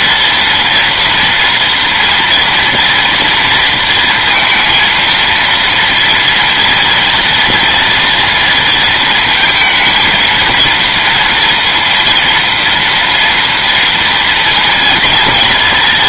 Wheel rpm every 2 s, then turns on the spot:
240, 230, 230, 240, 230, 230, 230, 230.
none